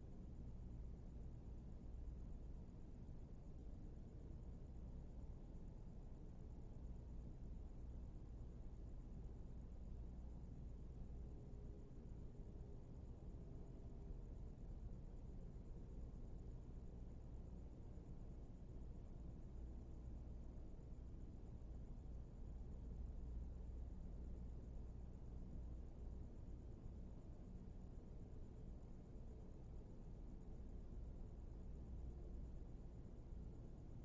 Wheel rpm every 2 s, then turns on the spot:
0, 0, 0, 0, 0, 0, 0, 0, 0, 0, 0, 0, 0, 0, 0, 0, 0.
none